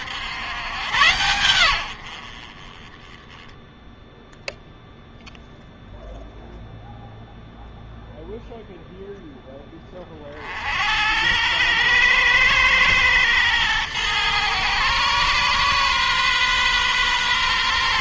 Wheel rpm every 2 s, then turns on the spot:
110, 40, 0, 0, 0, 70, 110, 120, 130.
none